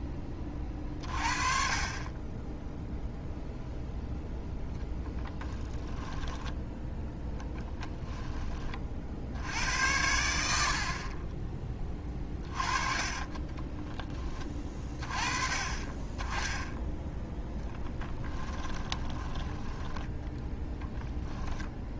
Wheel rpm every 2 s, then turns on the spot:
30, 0, 10, 10, 40, 60, 30, 30, 10, 20, 10.
4-6 12-14 18-20